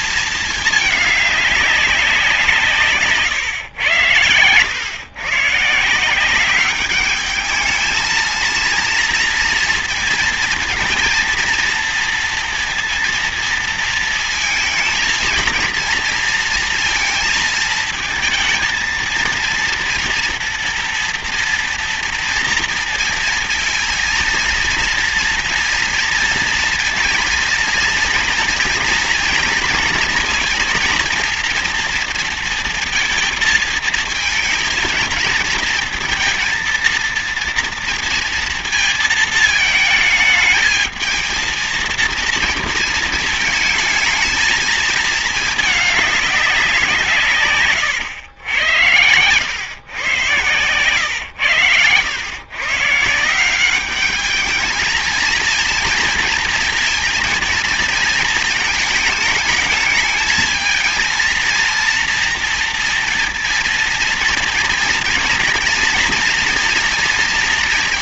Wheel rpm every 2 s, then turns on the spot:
210, 150, 120, 200, 230, 230, 230, 230, 230, 230, 230, 230, 230, 230, 230, 230, 220, 220, 230, 220, 220, 230, 220, 180, 100, 120, 140, 220, 230, 220, 230, 230, 230, 240.
none